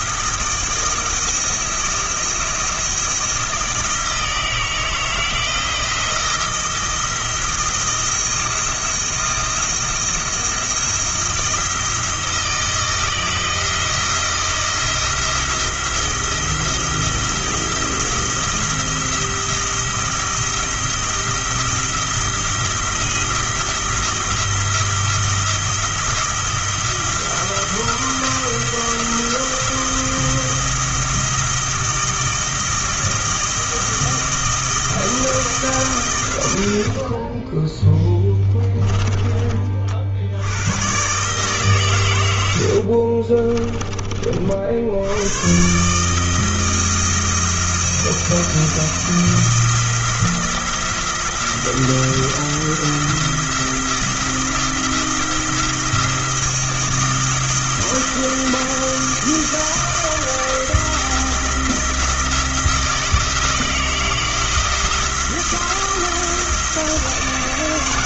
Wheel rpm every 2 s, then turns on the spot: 170, 170, 160, 170, 170, 170, 160, 170, 170, 170, 170, 170, 170, 170, 170, 170, 160, 160, 80, 20, 80, 80, 60, 160, 170, 170, 170, 170, 170, 170, 170, 160, 170, 160.
38-40 42-44